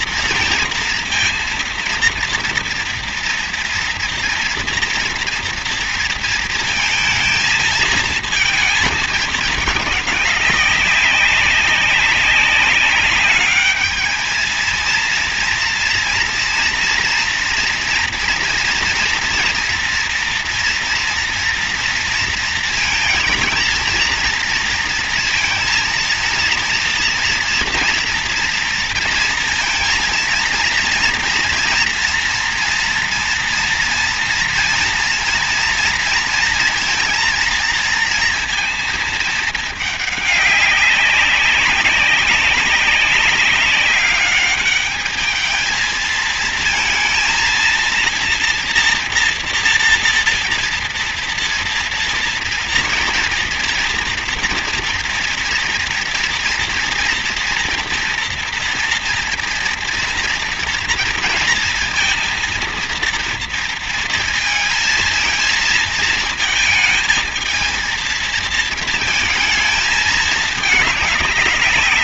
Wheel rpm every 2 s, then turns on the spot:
240, 230, 230, 230, 220, 200, 200, 220, 230, 230, 230, 230, 230, 230, 240, 230, 230, 230, 230, 230, 200, 200, 200, 230, 230, 230, 230, 240, 240, 230, 230, 230, 230, 220, 230, 210.
none